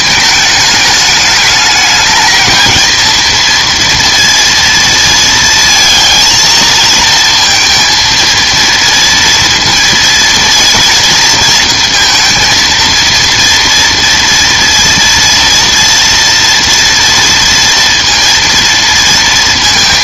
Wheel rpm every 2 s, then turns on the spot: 210, 220, 230, 230, 230, 230, 230, 230, 230, 230.
none